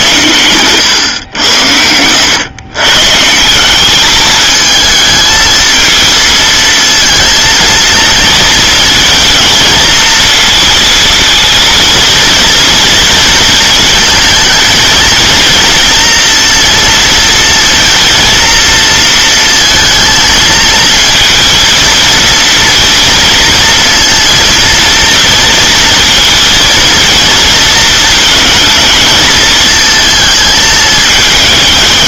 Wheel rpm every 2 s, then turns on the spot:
120, 130, 220, 220, 220, 230, 230, 230, 230, 230, 230, 240, 230, 230, 220, 220.
none